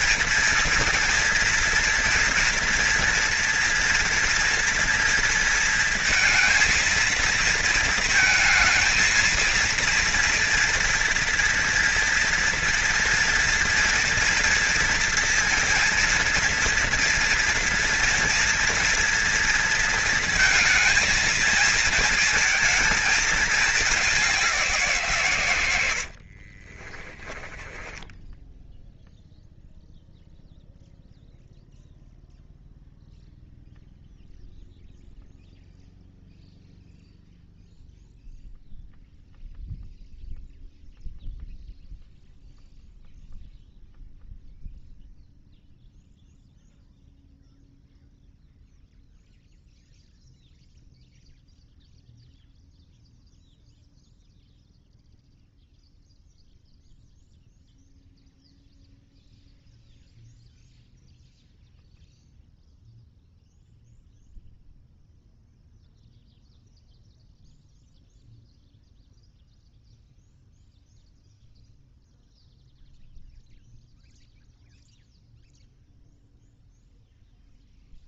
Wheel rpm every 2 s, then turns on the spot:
240, 230, 230, 230, 220, 230, 230, 230, 230, 230, 230, 220, 180, 40, 0, 0, 0, 0, 0, 0, 0, 0, 0, 0, 0, 0, 0, 0, 0, 0, 0, 0, 0, 0, 0, 0, 0, 0, 0.
26-28